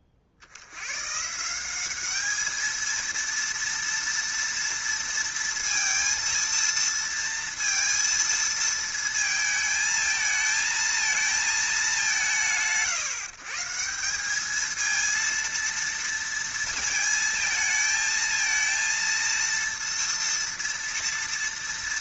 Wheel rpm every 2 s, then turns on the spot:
50, 220, 230, 230, 230, 220, 110, 210, 230, 220, 230.
none